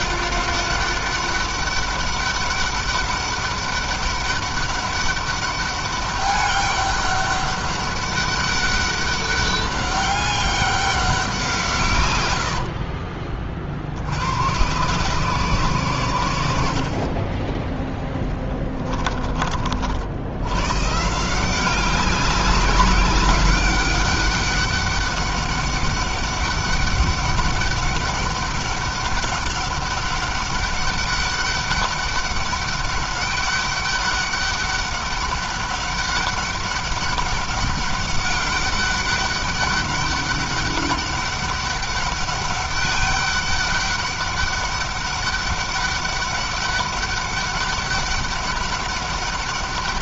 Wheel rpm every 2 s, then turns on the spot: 200, 200, 200, 200, 200, 190, 60, 120, 40, 20, 140, 190, 200, 200, 200, 200, 200, 200, 190, 200, 200, 200, 200, 200, 200.
18-20